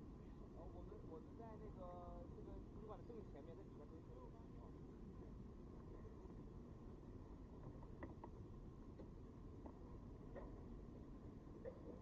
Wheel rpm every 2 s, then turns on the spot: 0, 0, 0, 0, 0, 0.
none